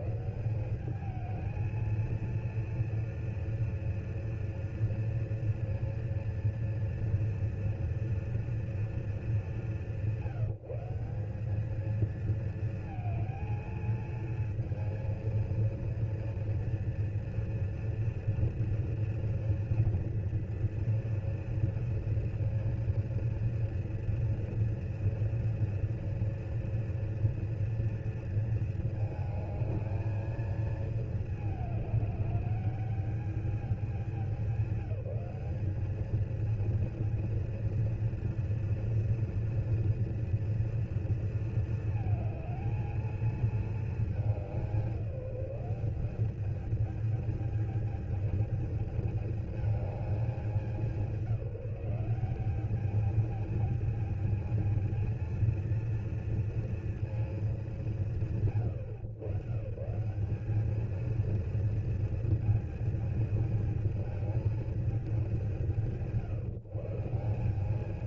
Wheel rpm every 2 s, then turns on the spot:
220, 230, 230, 230, 210, 180, 230, 230, 230, 230, 240, 240, 230, 230, 220, 220, 210, 190, 220, 230, 230, 220, 190, 210, 210, 190, 200, 220, 230, 100, 200, 230, 220, 150.
none